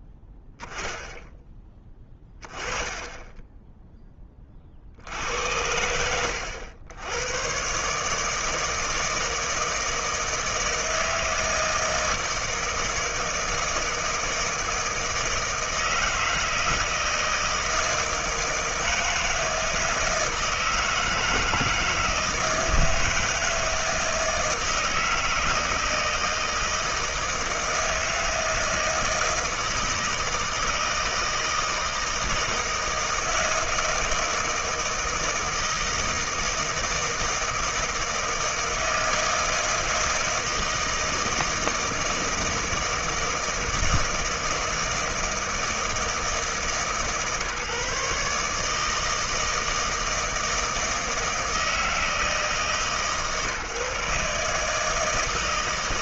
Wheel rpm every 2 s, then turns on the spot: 0, 10, 70, 110, 160, 160, 160, 160, 160, 160, 160, 160, 160, 160, 160, 160, 160, 160, 160, 160, 160, 160, 150, 140, 160, 160, 150, 160.
none